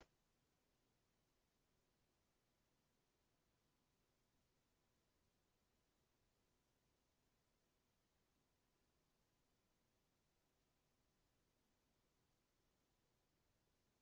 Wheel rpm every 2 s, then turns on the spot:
0, 0, 0, 0, 0, 0, 0.
none